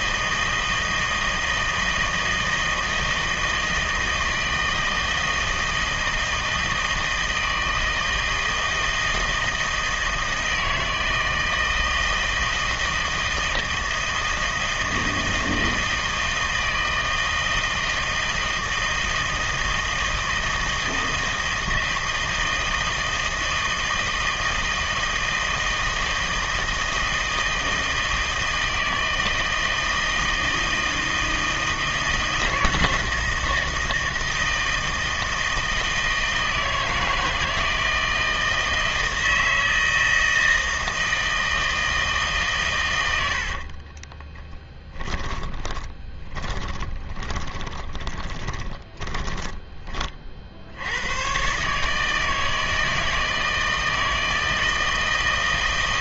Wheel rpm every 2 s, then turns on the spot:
160, 160, 160, 160, 160, 160, 160, 160, 160, 160, 160, 160, 160, 160, 160, 160, 160, 160, 160, 160, 160, 120, 10, 20, 20, 70, 160, 160.
44-50